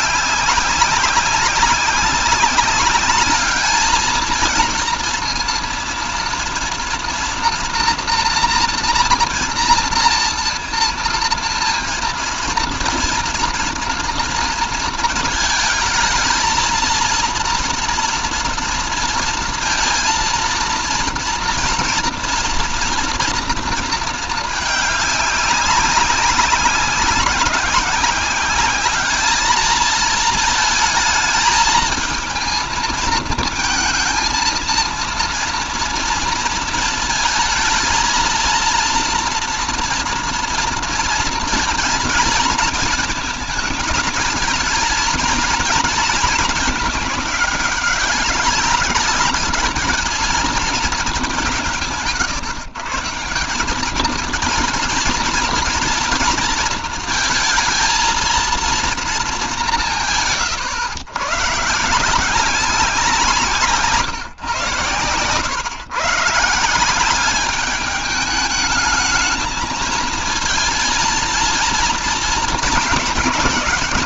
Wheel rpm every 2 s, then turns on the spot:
200, 200, 230, 240, 230, 230, 230, 230, 230, 230, 230, 230, 210, 190, 210, 220, 230, 230, 220, 230, 230, 220, 220, 210, 200, 220, 160, 220, 230, 230, 130, 180, 120, 180, 210, 230, 220.
none